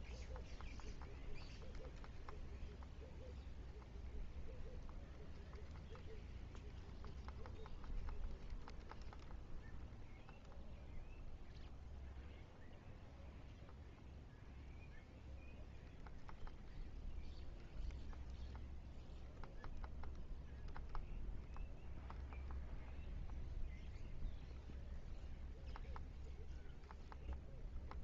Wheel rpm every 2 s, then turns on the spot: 0, 0, 0, 0, 0, 0, 0, 0, 0, 0, 0, 0, 0, 0.
none